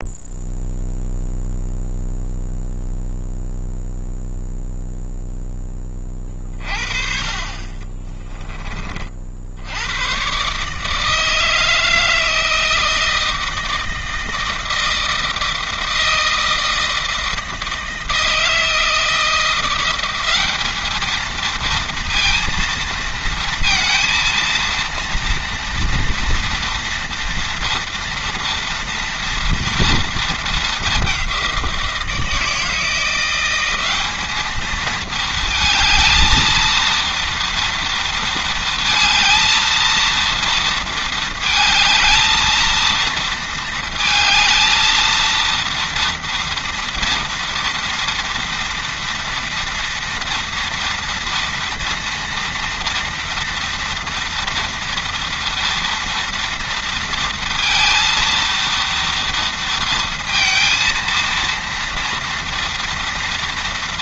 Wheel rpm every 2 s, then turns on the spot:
0, 0, 0, 30, 30, 150, 160, 160, 160, 160, 210, 230, 230, 230, 230, 210, 160, 220, 230, 230, 230, 230, 230, 230, 230, 230, 230, 230, 230, 230, 230, 230.
none